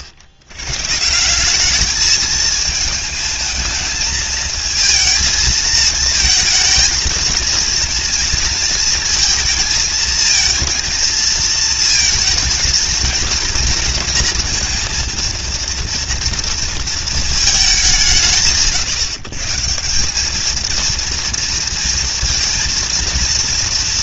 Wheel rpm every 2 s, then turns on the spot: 90, 220, 220, 230, 230, 230, 220, 230, 230, 110, 220, 230.
none